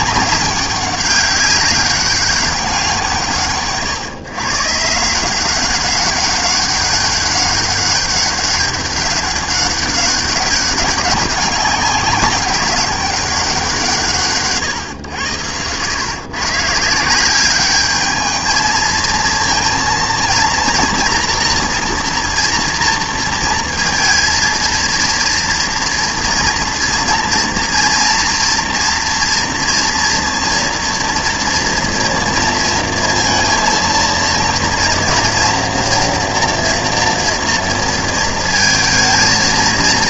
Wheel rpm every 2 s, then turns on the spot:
190, 190, 130, 200, 200, 190, 200, 140, 140, 220, 230, 240, 230, 230, 230, 230, 230, 230, 230, 220.
none